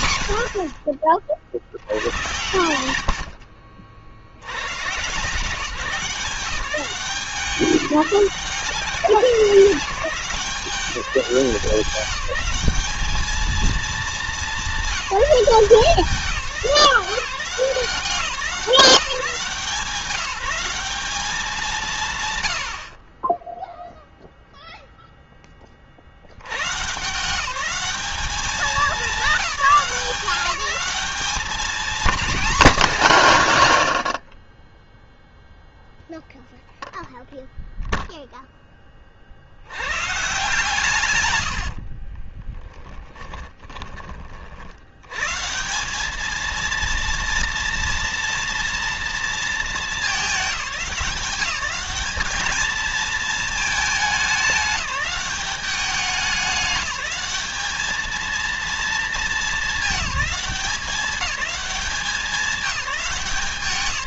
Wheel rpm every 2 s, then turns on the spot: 60, 90, 110, 180, 190, 190, 190, 200, 190, 170, 190, 90, 0, 100, 210, 200, 240, 20, 0, 10, 140, 20, 50, 220, 230, 210, 220, 210, 200, 220, 200, 200.
42-44